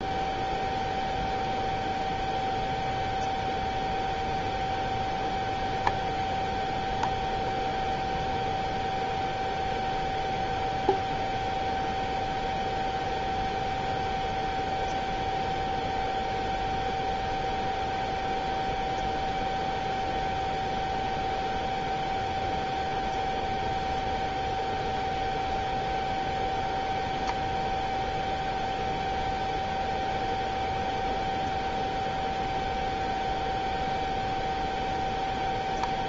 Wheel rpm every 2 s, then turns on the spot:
0, 0, 0, 0, 0, 0, 0, 0, 0, 0, 0, 0, 0, 0, 0, 0, 0, 0.
none